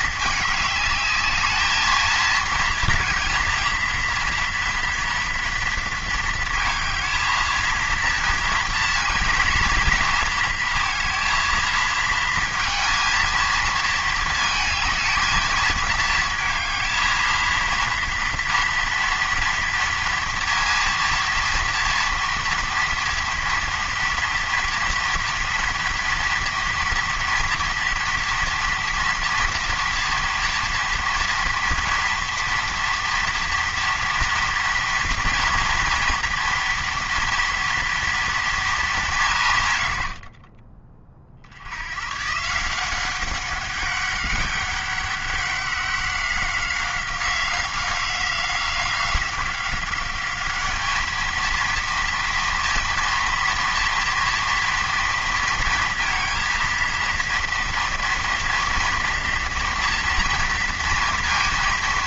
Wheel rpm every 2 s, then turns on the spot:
210, 230, 230, 220, 230, 230, 230, 220, 220, 230, 230, 230, 230, 230, 230, 230, 230, 230, 230, 220, 40, 160, 200, 190, 180, 210, 230, 230, 230, 240, 240.
40-42